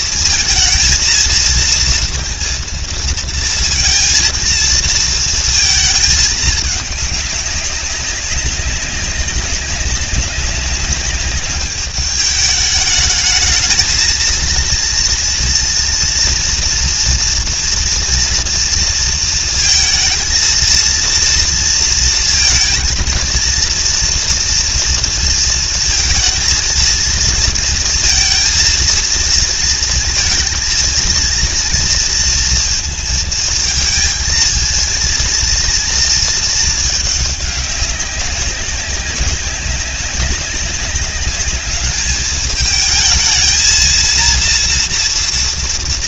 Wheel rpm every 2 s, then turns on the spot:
230, 230, 230, 210, 190, 200, 210, 230, 230, 230, 230, 230, 230, 230, 230, 230, 220, 230, 220, 200, 190, 220, 230.
none